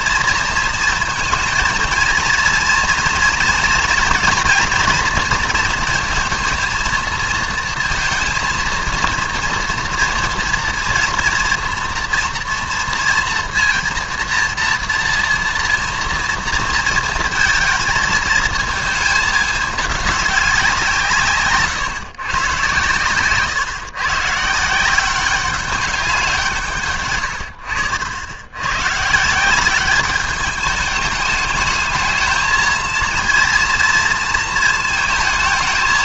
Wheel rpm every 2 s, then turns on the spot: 230, 230, 230, 230, 230, 230, 230, 240, 230, 220, 170, 130, 170, 130, 130, 210, 230, 220.
none